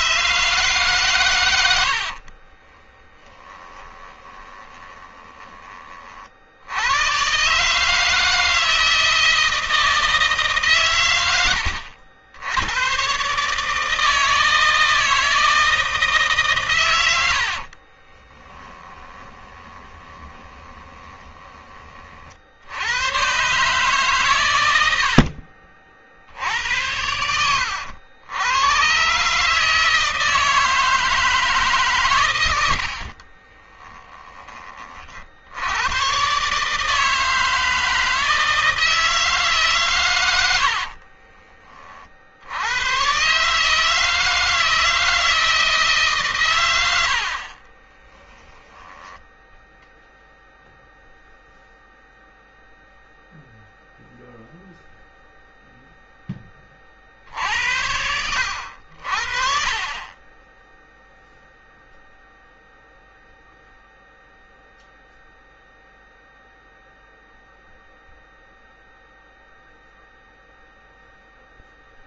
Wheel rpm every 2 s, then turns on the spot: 140, 40, 20, 50, 160, 150, 100, 160, 140, 30, 20, 50, 130, 60, 100, 160, 110, 30, 130, 160, 100, 60, 160, 130, 10, 0, 0, 0, 10, 80, 20, 0, 0, 0, 0, 0.
2-6 18-22 34-36 48-50